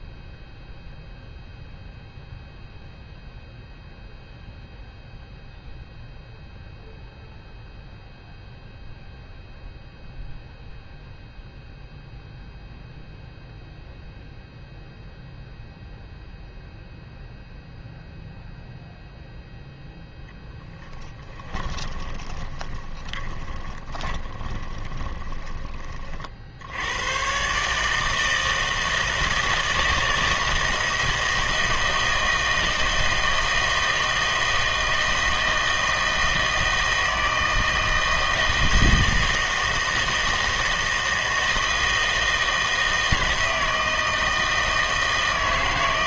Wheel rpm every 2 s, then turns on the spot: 0, 0, 0, 0, 0, 0, 0, 0, 0, 0, 10, 20, 20, 80, 160, 160, 160, 160, 160, 160, 160, 160, 160.
20-26